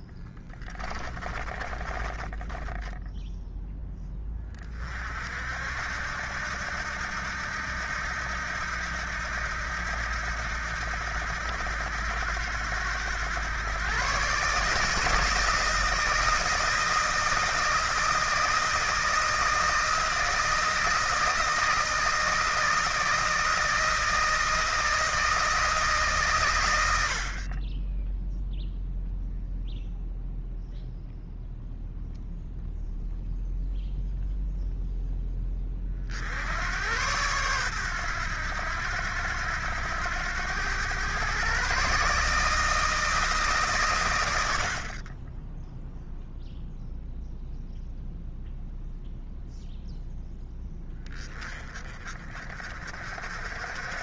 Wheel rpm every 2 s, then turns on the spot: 20, 10, 40, 80, 80, 80, 90, 150, 160, 160, 160, 160, 160, 100, 0, 0, 0, 0, 100, 90, 110, 160, 50, 0, 0, 10, 40.
0-2